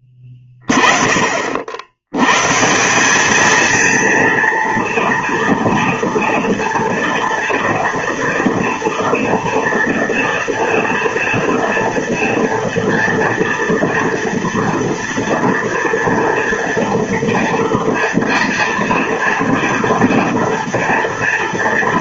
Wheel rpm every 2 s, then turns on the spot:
10, 160, 230, 230, 230, 230, 230, 230, 230, 230, 230.
none